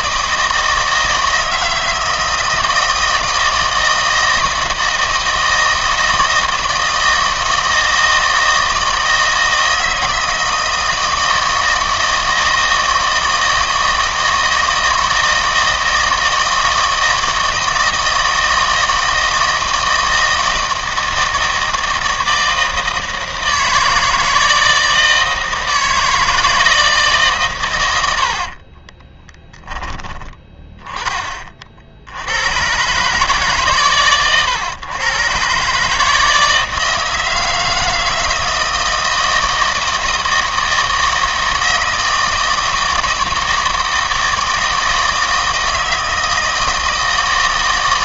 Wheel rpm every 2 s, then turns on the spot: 160, 160, 160, 160, 160, 160, 160, 160, 160, 160, 160, 160, 160, 160, 30, 10, 120, 110, 160, 160, 160, 160, 160, 160.
28-30